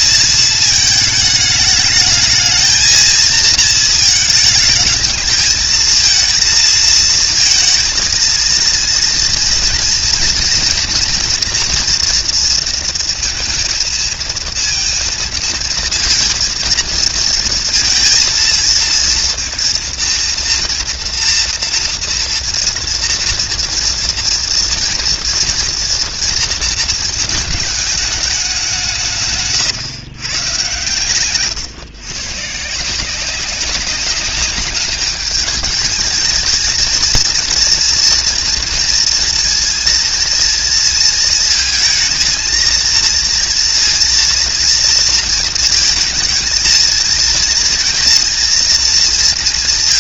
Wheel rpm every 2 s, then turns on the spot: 220, 220, 220, 230, 230, 240, 230, 230, 230, 230, 230, 230, 230, 230, 180, 130, 150, 210, 220, 240, 230, 230, 230, 220, 230.
none